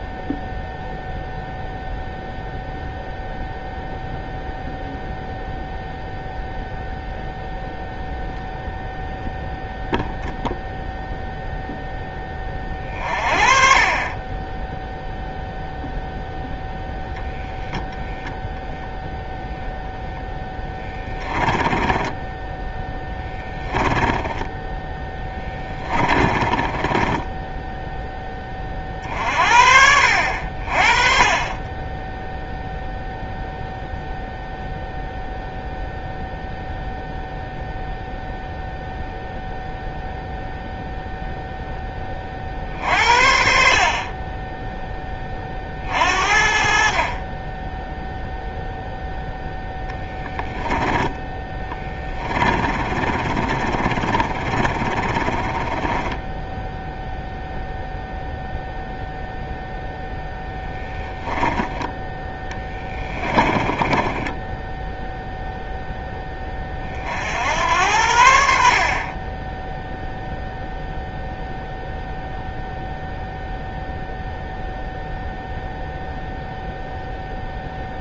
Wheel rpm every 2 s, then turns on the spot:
0, 0, 0, 0, 0, 0, 30, 0, 0, 0, 10, 10, 10, 10, 40, 30, 0, 0, 0, 0, 0, 50, 10, 40, 0, 10, 30, 20, 0, 0, 10, 20, 0, 50, 30, 0, 0, 0, 0.
20-28 50-56 62-64